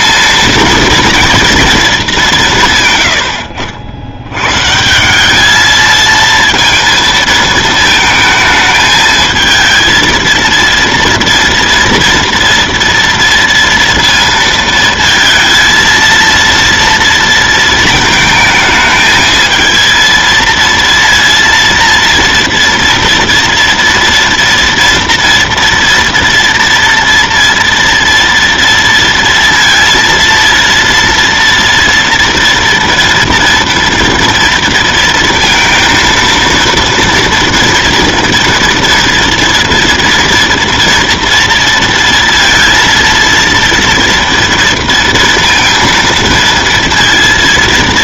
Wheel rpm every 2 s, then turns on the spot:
230, 140, 150, 230, 220, 230, 230, 230, 230, 220, 230, 230, 230, 230, 230, 230, 230, 230, 230, 230, 230, 230, 230, 230.
none